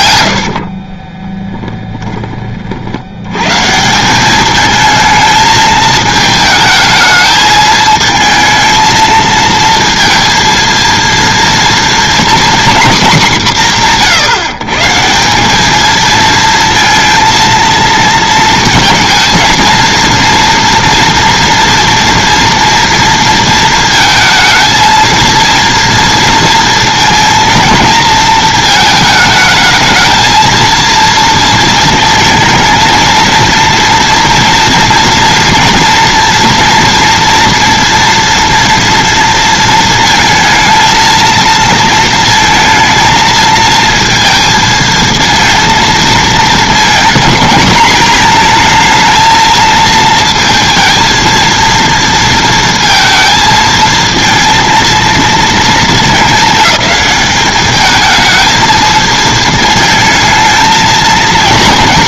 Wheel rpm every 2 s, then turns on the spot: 70, 40, 210, 220, 220, 230, 250, 140, 230, 220, 230, 230, 220, 230, 220, 230, 220, 230, 230, 230, 230, 230, 230, 220, 220, 230, 230, 230, 210, 220, 220.
0-2